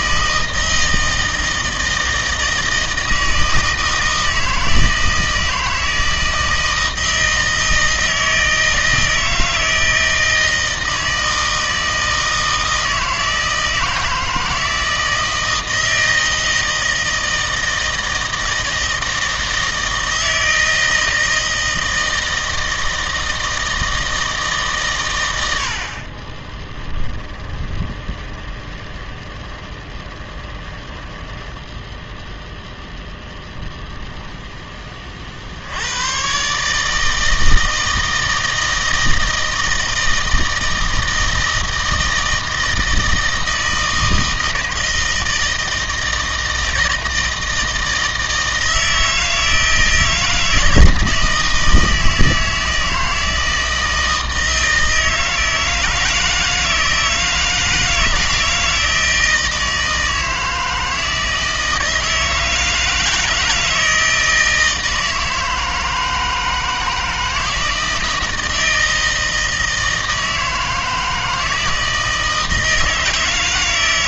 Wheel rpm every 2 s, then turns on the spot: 160, 160, 160, 160, 160, 160, 160, 160, 160, 160, 160, 160, 130, 10, 20, 10, 10, 20, 150, 160, 160, 160, 160, 160, 160, 160, 160, 160, 160, 160, 160, 160, 160, 160, 160, 160, 160.
26-32